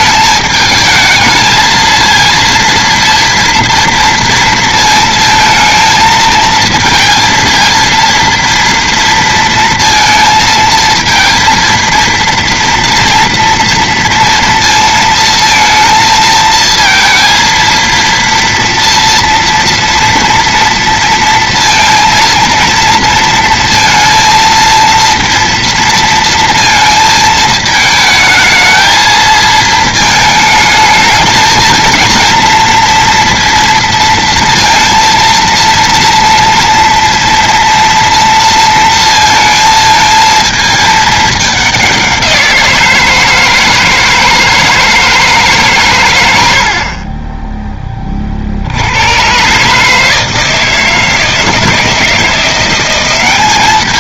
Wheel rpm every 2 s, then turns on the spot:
210, 230, 230, 230, 230, 220, 230, 230, 230, 230, 230, 230, 230, 230, 220, 220, 230, 230, 230, 230, 220, 170, 160, 60, 80, 160, 180.
none